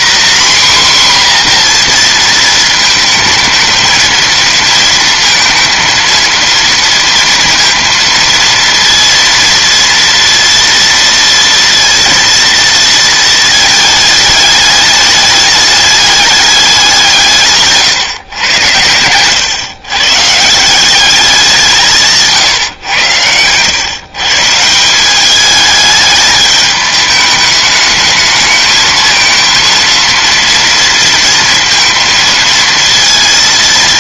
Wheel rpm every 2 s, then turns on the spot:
260, 220, 220, 230, 230, 230, 220, 210, 200, 100, 160, 140, 160, 210, 220, 230, 230.
none